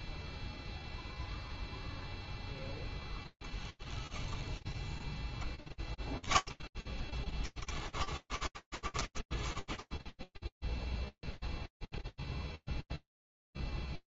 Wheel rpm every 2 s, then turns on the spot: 0, 0, 0, 0, 10, 0, 0.
none